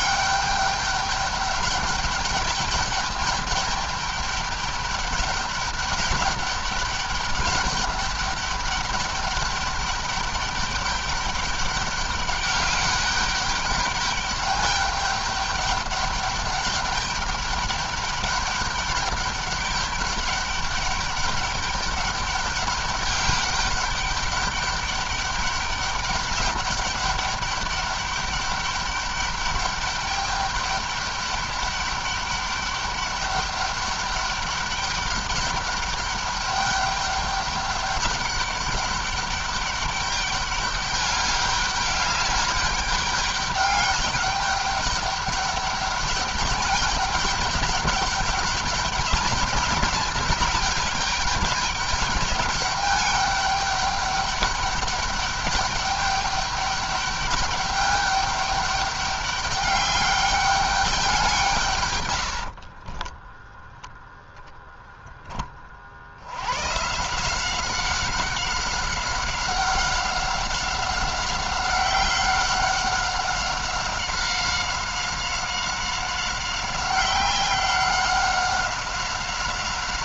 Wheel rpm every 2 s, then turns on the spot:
200, 200, 200, 200, 200, 200, 200, 200, 200, 200, 200, 200, 200, 200, 200, 200, 200, 200, 200, 200, 200, 200, 200, 210, 200, 200, 200, 200, 200, 200, 200, 50, 0, 120, 190, 190, 190, 190, 190, 190.
62-64